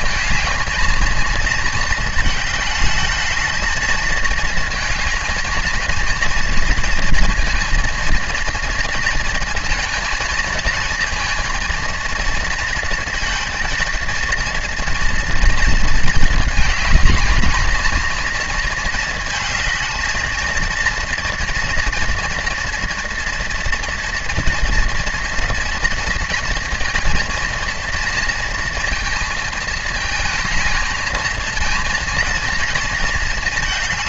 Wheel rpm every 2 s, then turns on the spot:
220, 210, 220, 230, 230, 220, 230, 230, 220, 230, 220, 240, 230, 230, 230, 220, 230.
none